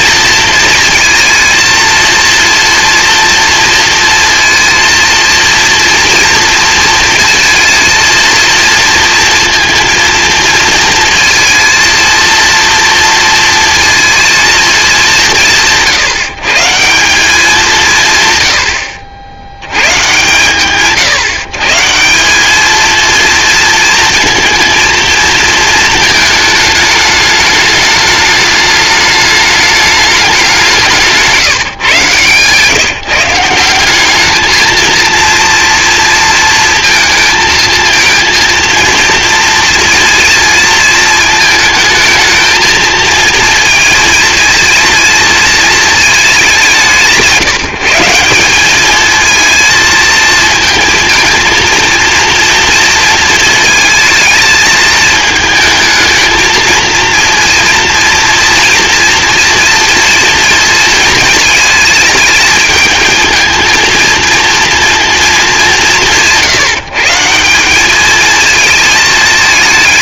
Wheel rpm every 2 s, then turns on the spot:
230, 230, 230, 230, 230, 230, 230, 220, 160, 100, 130, 210, 230, 210, 210, 180, 150, 220, 230, 230, 230, 220, 230, 190, 200, 230, 230, 220, 230, 240, 230, 220, 230, 160, 220.
none